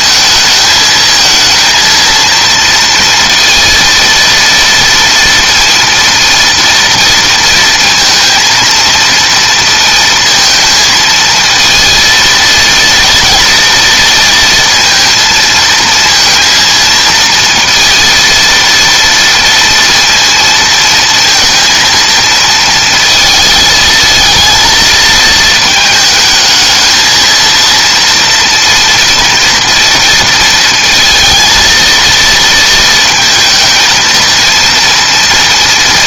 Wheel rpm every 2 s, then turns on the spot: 220, 230, 230, 230, 230, 230, 230, 230, 230, 230, 230, 230, 220, 220, 230, 230, 230, 230.
none